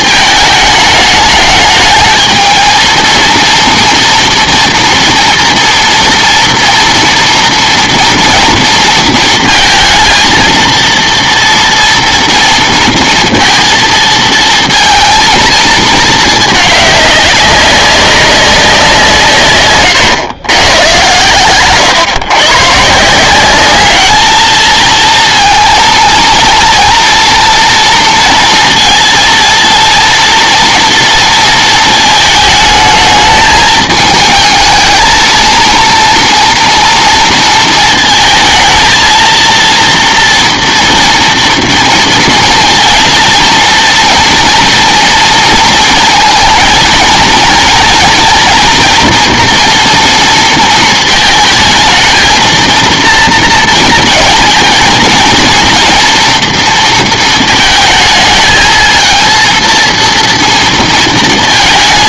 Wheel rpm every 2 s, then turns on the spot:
220, 220, 230, 240, 230, 230, 230, 230, 210, 180, 120, 130, 220, 230, 230, 230, 220, 220, 230, 220, 230, 230, 240, 230, 230, 230, 230, 230, 230, 220, 230.
none